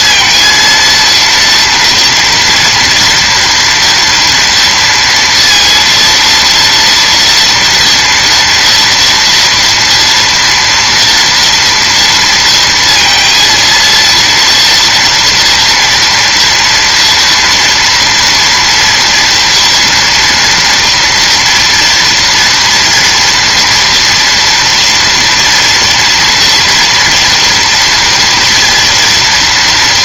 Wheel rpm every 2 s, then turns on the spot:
230, 240, 230, 230, 230, 230, 230, 230, 230, 230, 230, 230, 230, 230, 230.
none